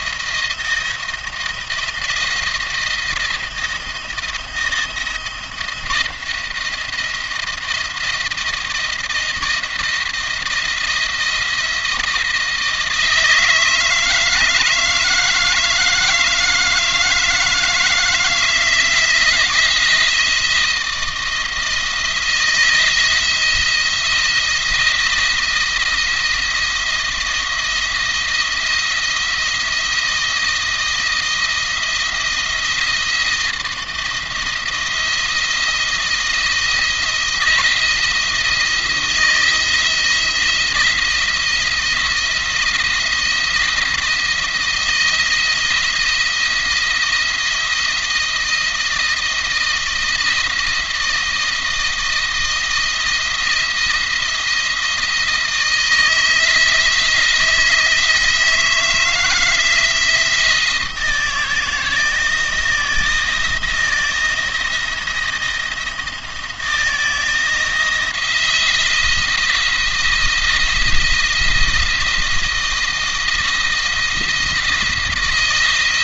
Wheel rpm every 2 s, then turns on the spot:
170, 170, 170, 170, 160, 170, 160, 160, 160, 160, 170, 170, 170, 160, 170, 160, 170, 170, 170, 170, 170, 170, 170, 170, 170, 170, 170, 170, 170, 160, 170, 160, 170, 160, 170, 170, 170, 170.
none